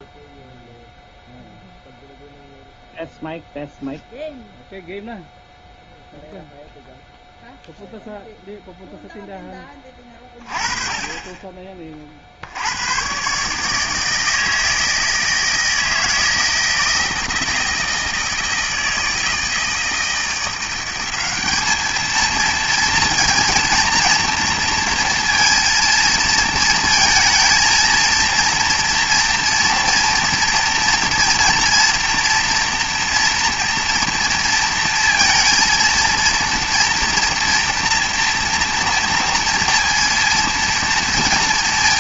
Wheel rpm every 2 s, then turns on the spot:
0, 0, 0, 0, 0, 30, 90, 160, 160, 160, 180, 230, 230, 220, 230, 230, 240, 230, 230, 230, 230.
none